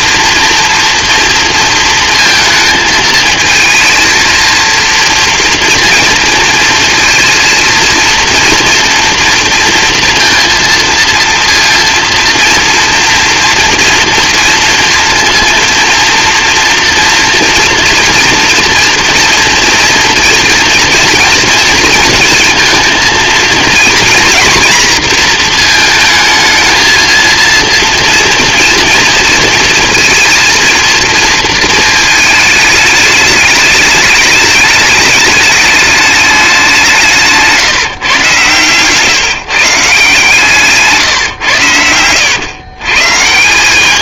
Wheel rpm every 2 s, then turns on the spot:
230, 220, 230, 230, 230, 230, 230, 230, 230, 240, 240, 230, 230, 230, 230, 230, 210, 210, 170, 140, 150, 130.
none